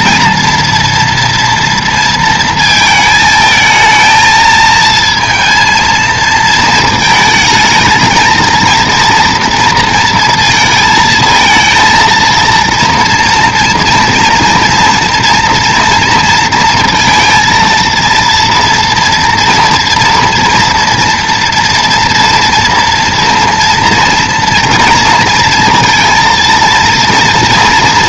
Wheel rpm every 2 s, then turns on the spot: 230, 230, 220, 220, 230, 230, 230, 230, 230, 230, 230, 230, 230, 230.
none